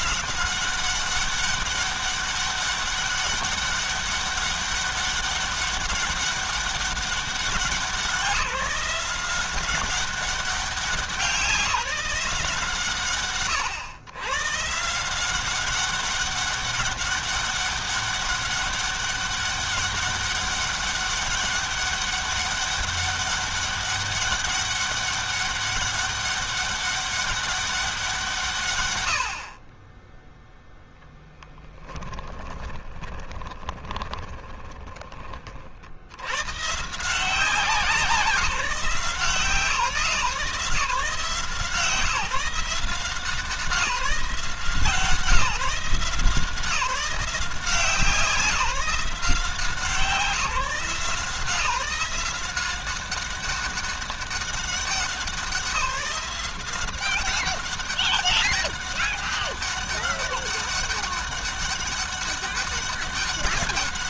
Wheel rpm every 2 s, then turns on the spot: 190, 200, 200, 190, 170, 190, 150, 140, 200, 200, 200, 200, 200, 200, 110, 10, 20, 20, 150, 170, 160, 180, 180, 180, 180, 160, 190, 200, 190, 200, 200, 200.
32-34